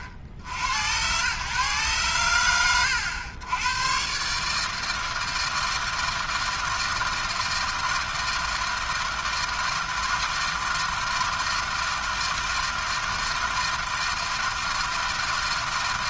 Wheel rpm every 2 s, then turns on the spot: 80, 90, 160, 160, 160, 160, 160, 160.
none